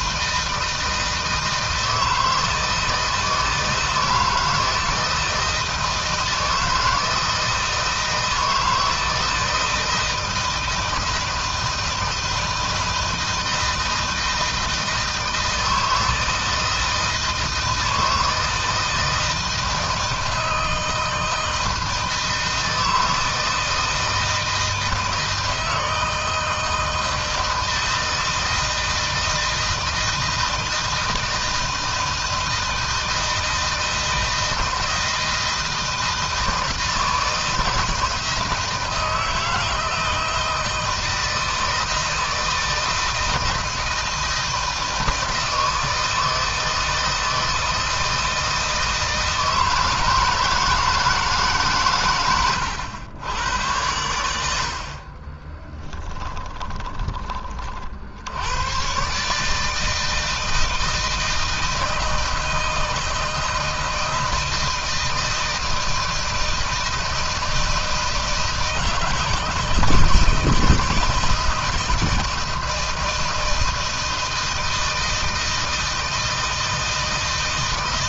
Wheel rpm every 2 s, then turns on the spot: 160, 160, 160, 160, 160, 160, 160, 160, 160, 160, 160, 160, 160, 160, 160, 160, 160, 160, 160, 160, 160, 160, 160, 160, 160, 160, 110, 60, 20, 120, 160, 160, 160, 160, 160, 160, 160, 160, 160.
none